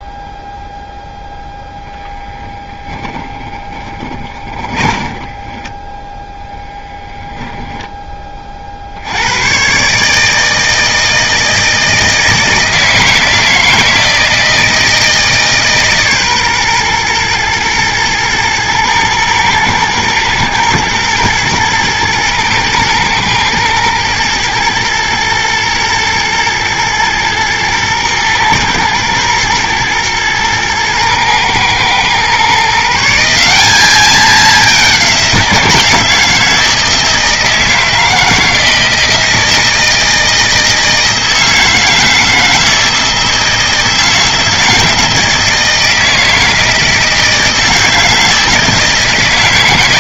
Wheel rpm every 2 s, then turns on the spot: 0, 10, 30, 20, 60, 160, 160, 160, 120, 110, 110, 110, 120, 120, 110, 110, 150, 190, 160, 160, 160, 160, 160, 160, 160.
4-6